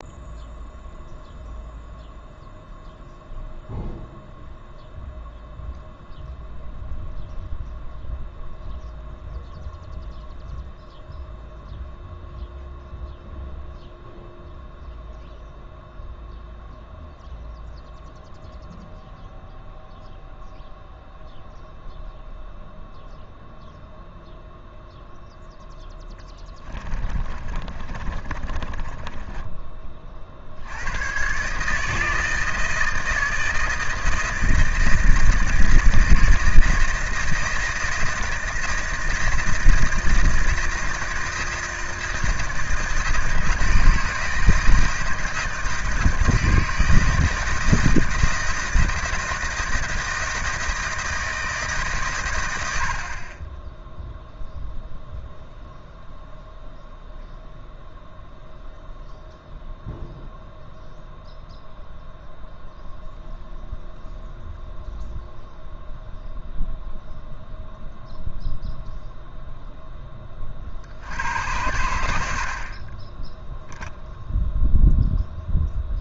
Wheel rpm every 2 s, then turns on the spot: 0, 0, 0, 0, 0, 0, 0, 0, 0, 0, 0, 0, 0, 20, 30, 80, 160, 160, 160, 160, 160, 160, 160, 160, 160, 160, 80, 0, 0, 0, 0, 0, 0, 0, 0, 40, 40, 0.
26-30